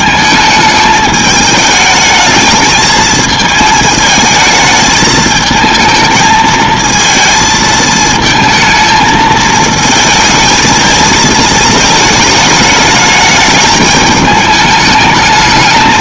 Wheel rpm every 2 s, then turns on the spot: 220, 220, 220, 220, 220, 220, 210, 210.
none